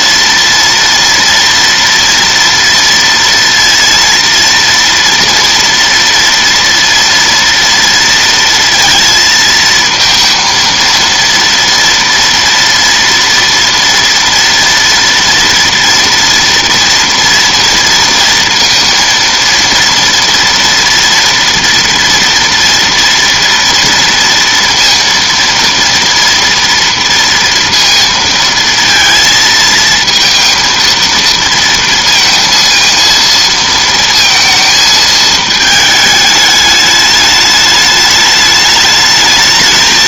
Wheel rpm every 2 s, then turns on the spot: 230, 230, 230, 230, 230, 230, 230, 230, 230, 230, 230, 230, 230, 230, 230, 230, 230, 220, 210, 210.
none